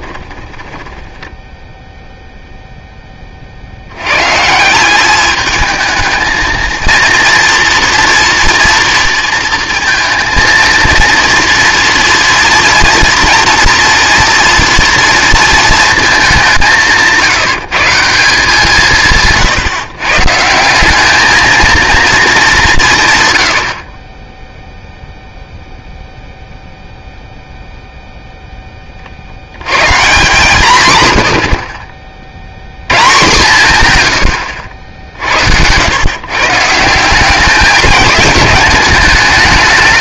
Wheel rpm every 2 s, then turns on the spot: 10, 0, 170, 230, 230, 230, 240, 230, 190, 170, 160, 170, 0, 0, 10, 150, 90, 90, 150, 220.
0-2